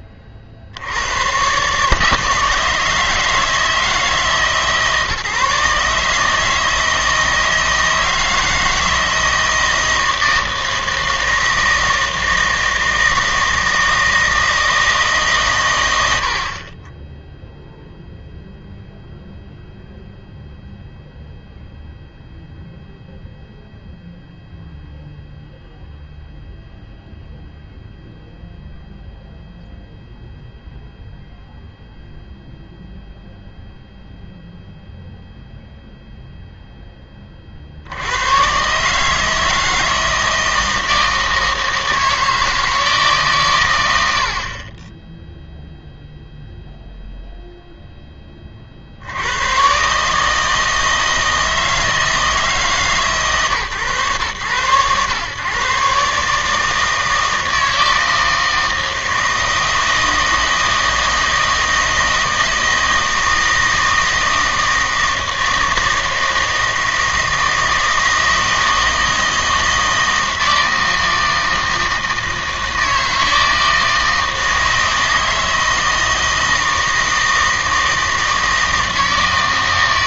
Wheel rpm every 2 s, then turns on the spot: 60, 160, 150, 160, 160, 160, 160, 160, 30, 0, 0, 0, 0, 0, 0, 0, 0, 0, 0, 130, 160, 160, 20, 0, 40, 160, 150, 110, 150, 160, 160, 160, 160, 160, 160, 160, 160, 160, 160, 160.
none